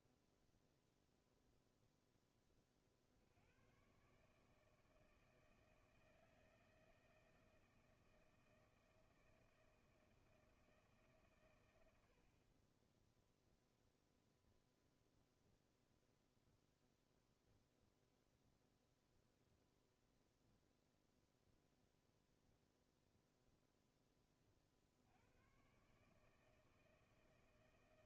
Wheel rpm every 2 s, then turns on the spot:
0, 20, 150, 160, 160, 160, 50, 0, 0, 0, 0, 0, 30, 160.
none